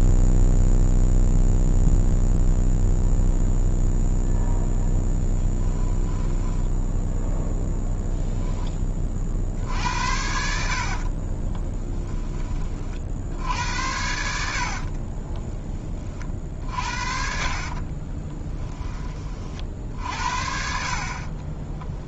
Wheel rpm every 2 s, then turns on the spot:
0, 0, 10, 10, 10, 60, 30, 50, 50, 20, 50.
6-8 10-12 14-18